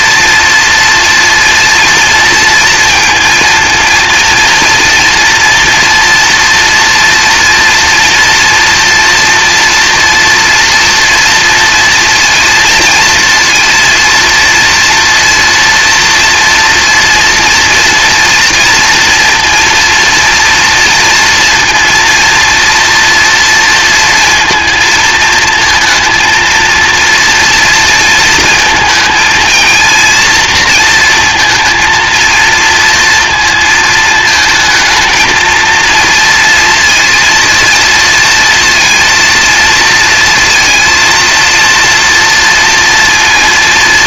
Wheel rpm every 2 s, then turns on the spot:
240, 230, 230, 230, 230, 230, 230, 230, 230, 230, 230, 230, 230, 230, 220, 230, 230, 220, 230, 230, 230, 230.
none